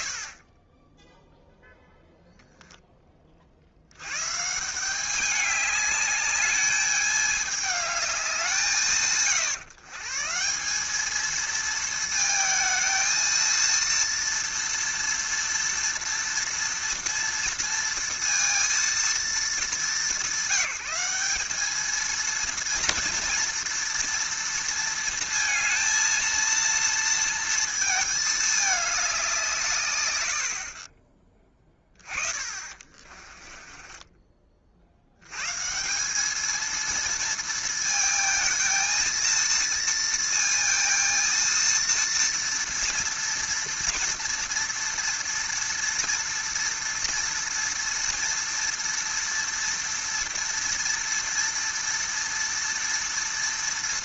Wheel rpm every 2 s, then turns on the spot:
20, 0, 160, 210, 170, 180, 220, 230, 240, 230, 180, 230, 230, 230, 210, 50, 40, 50, 220, 220, 230, 230, 230, 230, 230, 230, 230.
30-34